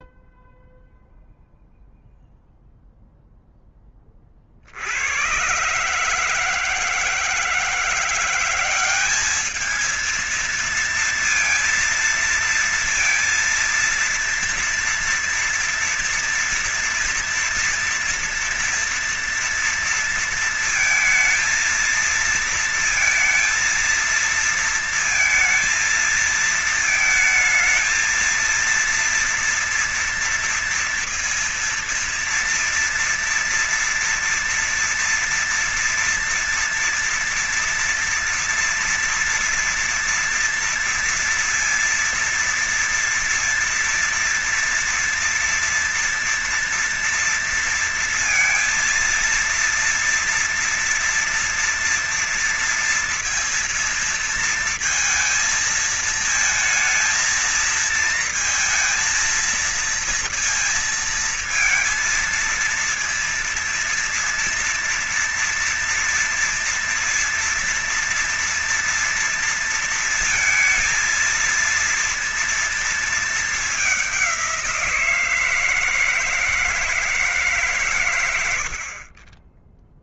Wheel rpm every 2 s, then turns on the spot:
0, 0, 40, 160, 180, 220, 230, 230, 230, 230, 230, 230, 230, 220, 230, 230, 230, 230, 230, 230, 230, 240, 230, 230, 230, 230, 230, 230, 220, 230, 230, 230, 230, 230, 230, 230, 230, 190, 160, 100.
none